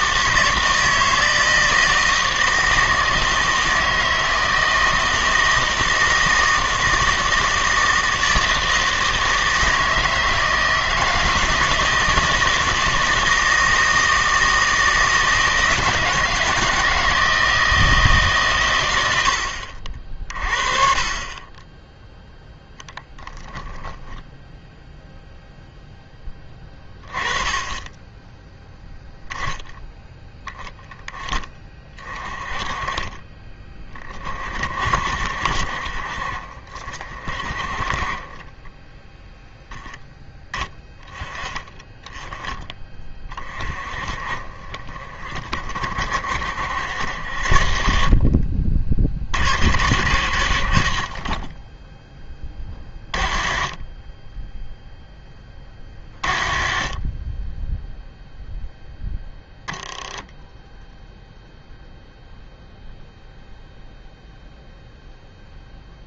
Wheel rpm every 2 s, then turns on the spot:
160, 160, 160, 160, 160, 160, 160, 160, 160, 130, 40, 0, 0, 20, 0, 10, 30, 50, 40, 20, 10, 20, 30, 70, 50, 80, 20, 10, 40, 0, 10, 0, 0.
none